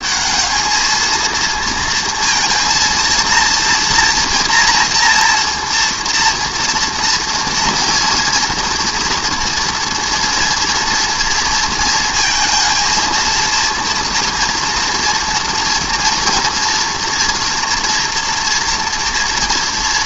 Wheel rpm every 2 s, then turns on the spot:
210, 230, 230, 230, 230, 230, 230, 230, 230, 240.
none